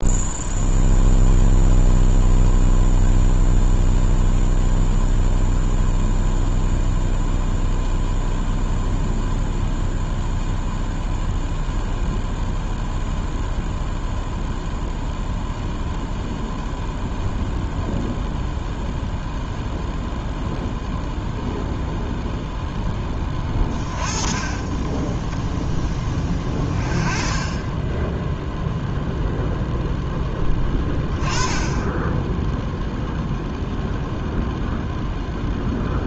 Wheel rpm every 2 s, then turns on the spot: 0, 0, 0, 0, 0, 0, 0, 0, 0, 0, 0, 0, 20, 20, 0, 10, 0, 0.
none